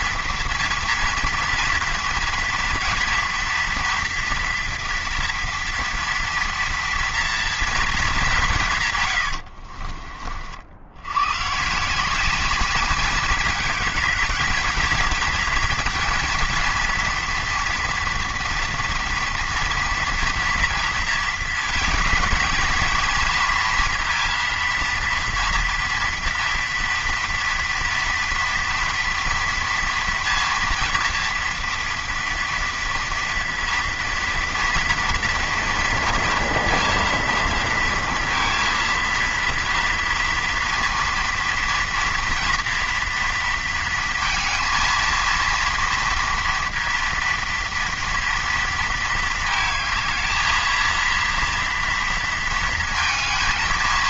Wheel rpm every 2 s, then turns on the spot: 230, 230, 230, 230, 160, 60, 200, 220, 230, 230, 230, 230, 230, 230, 230, 230, 230, 230, 230, 230, 230, 230, 230, 230, 230, 220, 230.
none